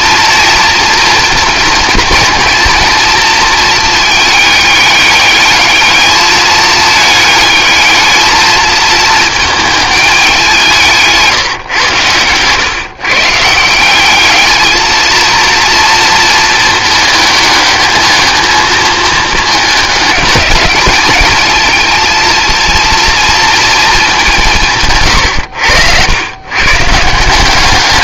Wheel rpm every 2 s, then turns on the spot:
230, 230, 210, 220, 220, 170, 130, 220, 220, 220, 210, 230, 140, 140.
none